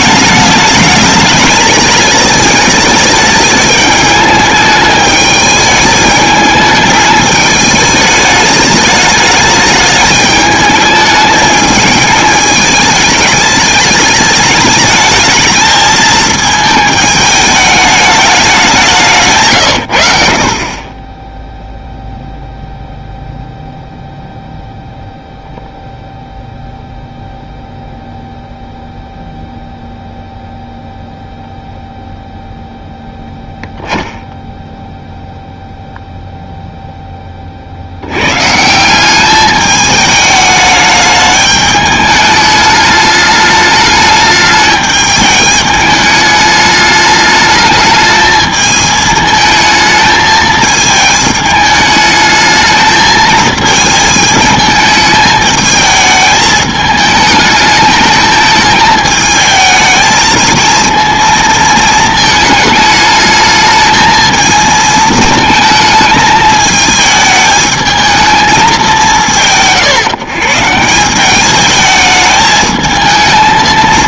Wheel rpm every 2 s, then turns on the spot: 210, 210, 210, 210, 210, 210, 210, 210, 220, 190, 40, 0, 0, 0, 0, 0, 0, 10, 0, 160, 210, 210, 210, 210, 220, 220, 220, 220, 220, 220, 230, 220, 220, 220, 190, 150, 220.
none